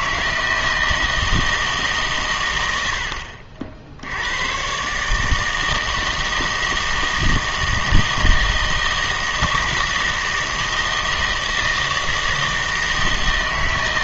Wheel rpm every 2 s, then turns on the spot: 160, 90, 120, 160, 160, 160, 160.
none